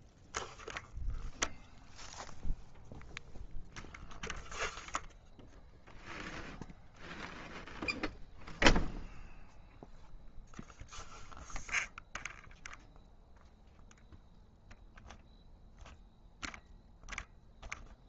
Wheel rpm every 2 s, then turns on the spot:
0, 0, 0, 0, 0, 0, 0, 0, 0.
none